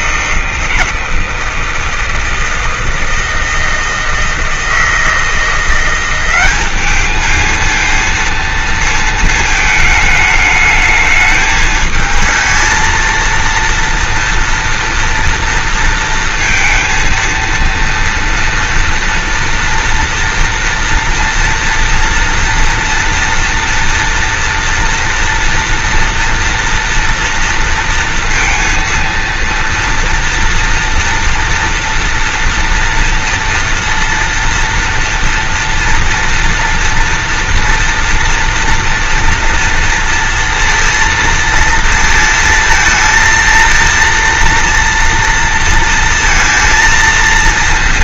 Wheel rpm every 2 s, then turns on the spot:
160, 160, 160, 210, 230, 210, 220, 230, 230, 230, 230, 230, 230, 230, 230, 230, 230, 230, 230, 230, 230, 230, 230, 230.
none